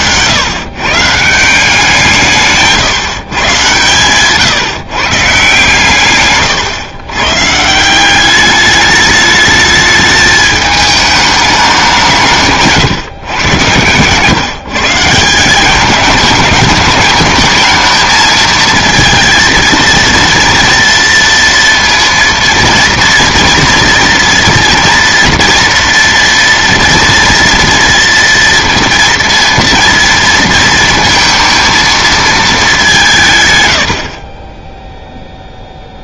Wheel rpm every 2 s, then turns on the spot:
130, 150, 140, 120, 200, 210, 150, 150, 210, 220, 230, 230, 230, 230, 230, 230, 200, 10.
none